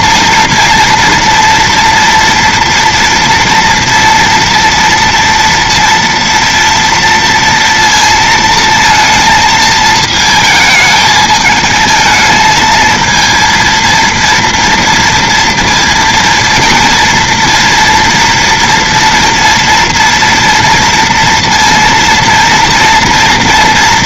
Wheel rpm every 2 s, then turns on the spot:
230, 230, 230, 230, 230, 220, 220, 230, 230, 230, 230, 230.
none